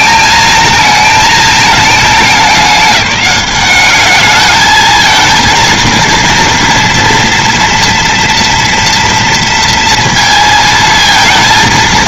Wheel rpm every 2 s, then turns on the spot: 220, 200, 220, 230, 240, 220.
none